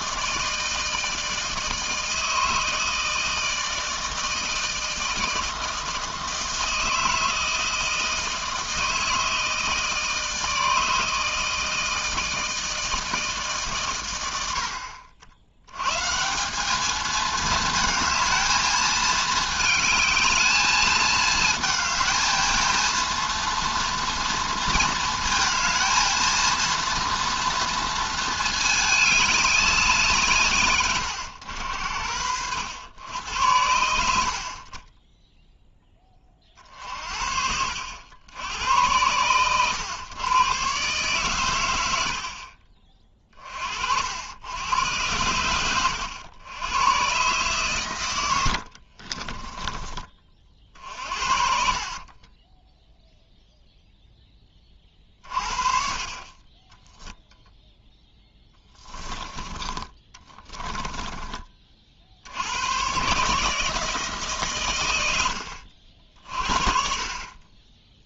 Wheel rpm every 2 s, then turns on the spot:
160, 160, 160, 160, 160, 160, 160, 80, 200, 220, 220, 230, 230, 230, 220, 130, 80, 40, 40, 90, 120, 40, 90, 100, 70, 50, 10, 20, 20, 10, 20, 100, 130, 40.
48-50 52-54 58-62